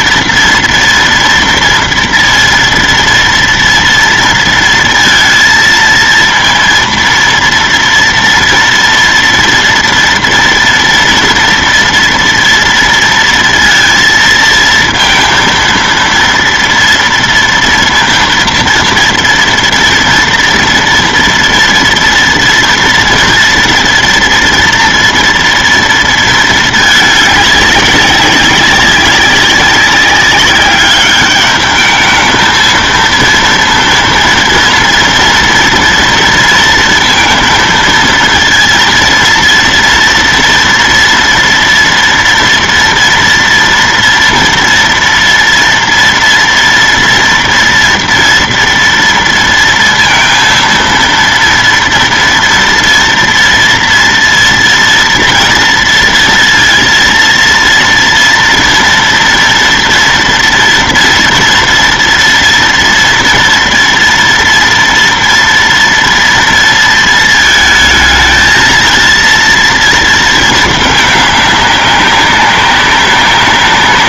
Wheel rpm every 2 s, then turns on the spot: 230, 230, 230, 230, 240, 230, 230, 230, 230, 230, 230, 230, 230, 220, 200, 200, 220, 230, 230, 230, 230, 240, 230, 230, 230, 230, 230, 230, 230, 230, 230, 230, 230, 230, 230, 220, 200.
none